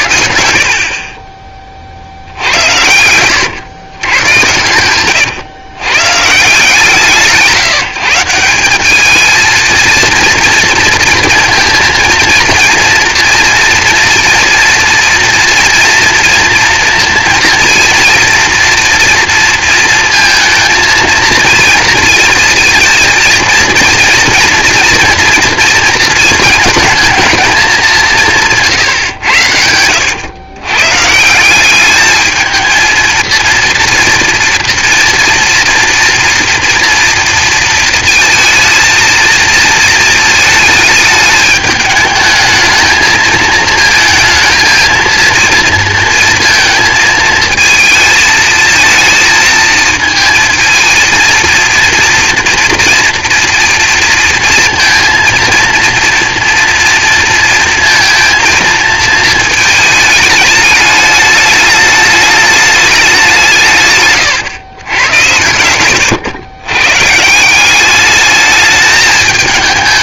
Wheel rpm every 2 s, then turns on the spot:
50, 100, 100, 150, 190, 230, 230, 230, 230, 240, 230, 220, 230, 220, 150, 120, 220, 230, 240, 230, 220, 220, 230, 230, 220, 220, 230, 230, 230, 230, 210, 210, 120, 120, 210.
2-6